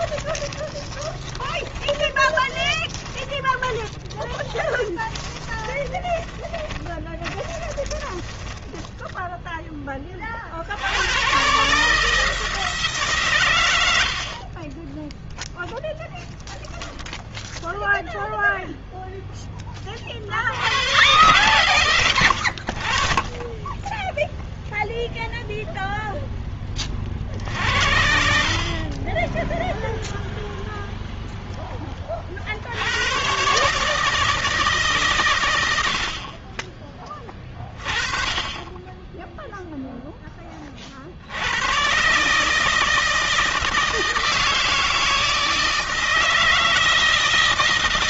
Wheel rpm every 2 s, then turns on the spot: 20, 20, 20, 20, 10, 80, 150, 20, 0, 0, 100, 40, 0, 30, 40, 0, 80, 150, 30, 20, 40, 160, 160, 160.
0-8